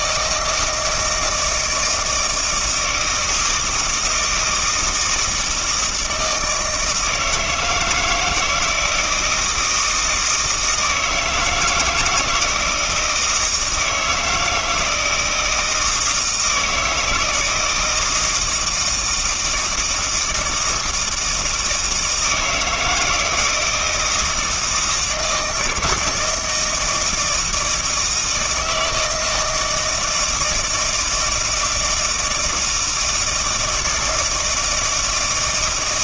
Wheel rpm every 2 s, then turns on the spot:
160, 160, 160, 160, 160, 160, 160, 160, 160, 170, 160, 160, 160, 160, 160, 160, 160, 160.
none